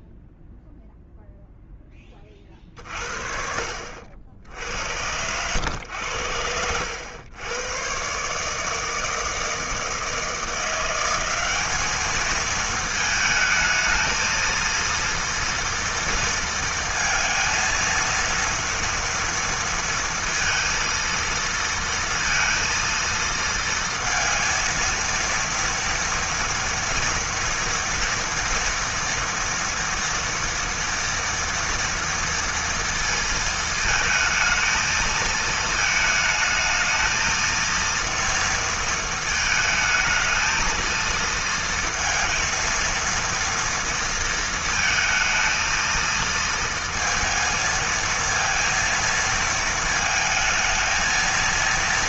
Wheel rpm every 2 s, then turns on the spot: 0, 60, 90, 100, 160, 190, 220, 230, 230, 230, 230, 230, 230, 230, 230, 230, 230, 220, 220, 230, 230, 230, 230, 230, 230, 230.
none